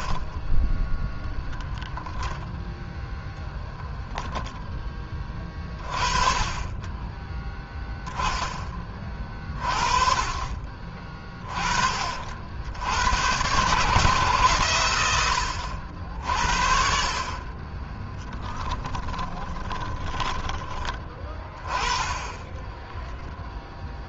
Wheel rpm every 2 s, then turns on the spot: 0, 0, 20, 20, 30, 30, 90, 120, 50, 10, 20, 10.
18-20 22-24